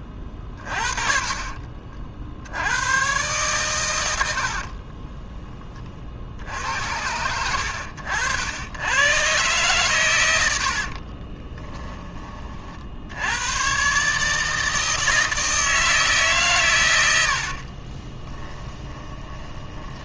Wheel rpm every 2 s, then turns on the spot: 30, 80, 60, 70, 90, 70, 50, 160, 130, 10.
0-2 4-6 10-12 18-20